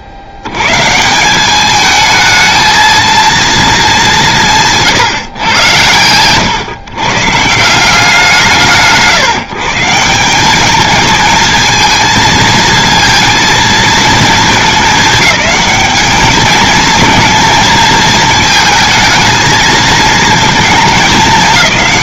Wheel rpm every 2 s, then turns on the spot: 130, 220, 170, 120, 140, 210, 230, 210, 220, 220, 220.
none